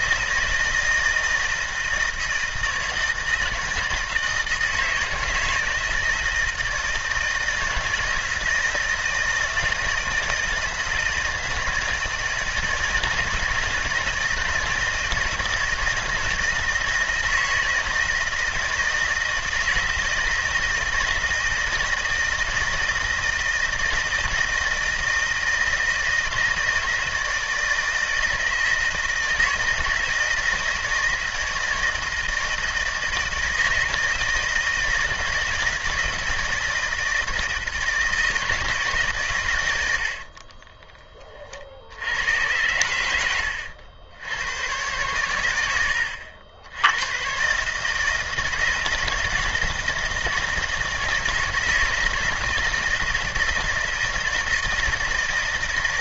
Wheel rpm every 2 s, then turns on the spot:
160, 160, 160, 160, 160, 160, 160, 160, 160, 160, 160, 160, 160, 160, 160, 160, 160, 160, 160, 160, 40, 100, 110, 80, 160, 160, 170, 160.
40-42